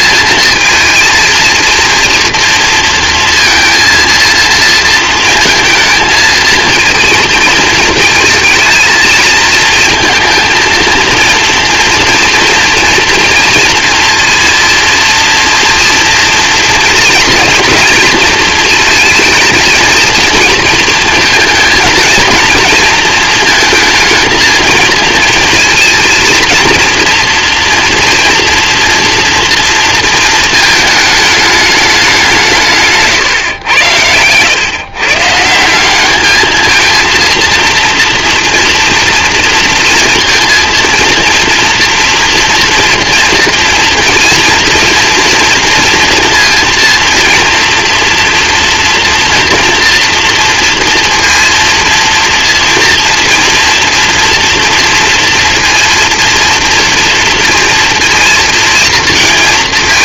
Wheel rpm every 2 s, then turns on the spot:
220, 230, 230, 230, 220, 230, 230, 230, 230, 230, 230, 230, 220, 230, 240, 220, 170, 120, 220, 240, 230, 230, 230, 230, 240, 230, 230, 230, 230, 230.
none